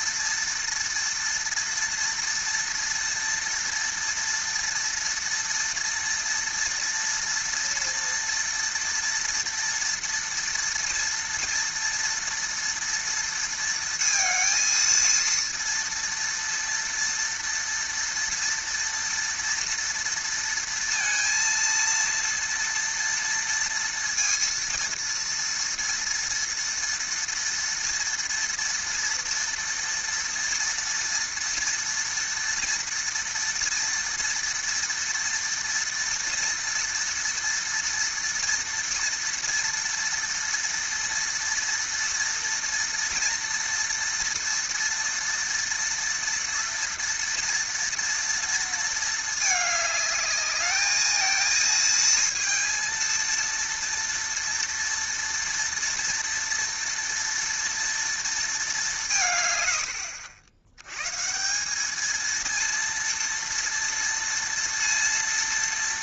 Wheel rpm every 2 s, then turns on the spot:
230, 230, 230, 230, 230, 230, 230, 230, 230, 240, 230, 230, 230, 230, 230, 230, 230, 230, 230, 230, 230, 230, 230, 230, 230, 210, 230, 230, 230, 220, 80, 220, 230.
none